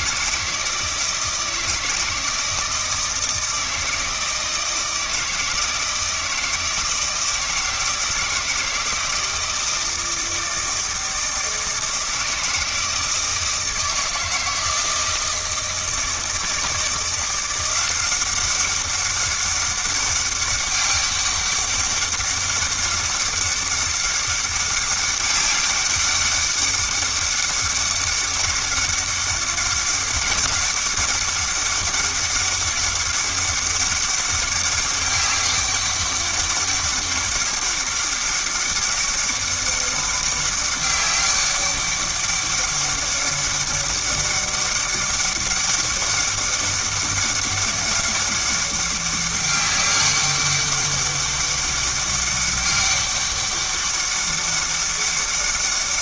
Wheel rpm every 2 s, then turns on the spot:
160, 160, 160, 160, 160, 160, 160, 160, 160, 190, 200, 200, 200, 200, 200, 200, 200, 200, 200, 200, 200, 200, 200, 200, 200, 200, 200, 200.
none